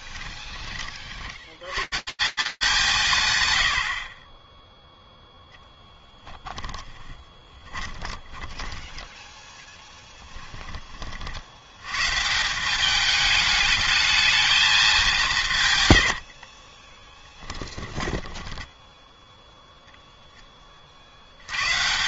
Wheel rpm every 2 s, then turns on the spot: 30, 200, 60, 20, 20, 20, 180, 210, 40, 10, 50.
4-10 16-20